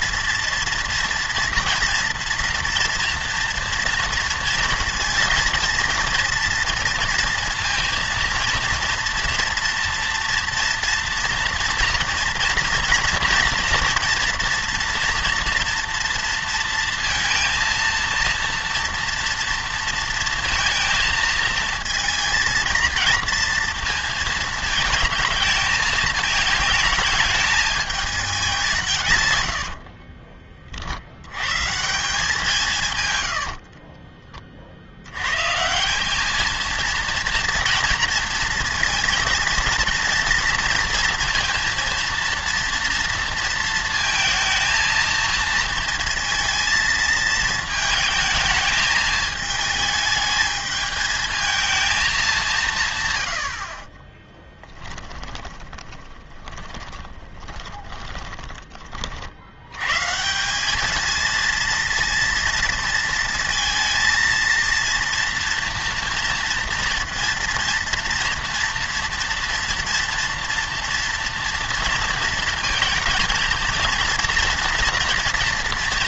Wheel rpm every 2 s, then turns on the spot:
230, 230, 230, 230, 240, 230, 230, 240, 230, 230, 230, 230, 220, 220, 180, 40, 160, 40, 220, 230, 230, 230, 230, 230, 220, 220, 170, 10, 20, 20, 200, 230, 230, 240, 230, 230, 230, 230.
54-58